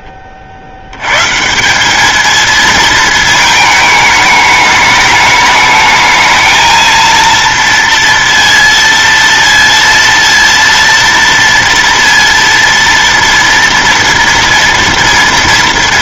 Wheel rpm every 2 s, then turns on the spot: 60, 220, 210, 220, 230, 230, 230, 230.
none